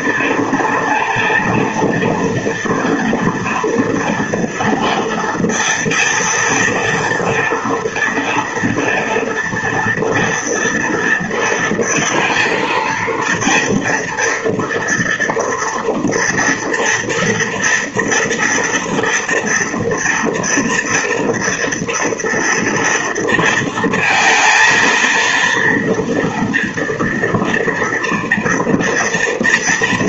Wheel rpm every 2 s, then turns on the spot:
230, 230, 230, 230, 230, 240, 230, 230, 230, 240, 230, 230, 230, 230, 230.
none